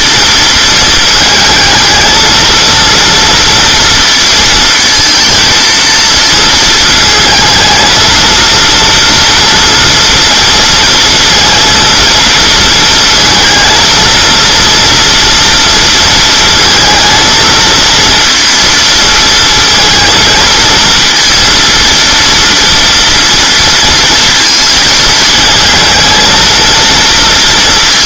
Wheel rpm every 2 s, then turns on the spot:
230, 230, 230, 220, 230, 240, 230, 230, 220, 230, 230, 230, 220, 230.
none